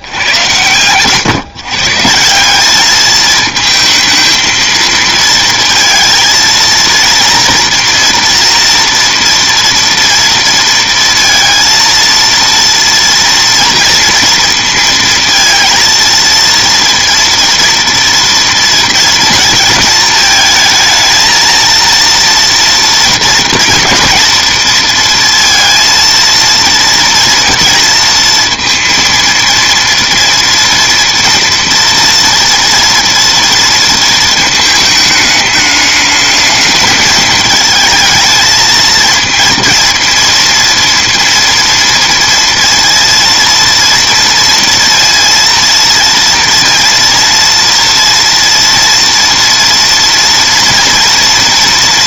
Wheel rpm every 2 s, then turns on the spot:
120, 200, 220, 230, 240, 230, 240, 230, 230, 230, 220, 230, 230, 230, 230, 230, 230, 220, 220, 220, 230, 230, 230, 230, 230, 230.
none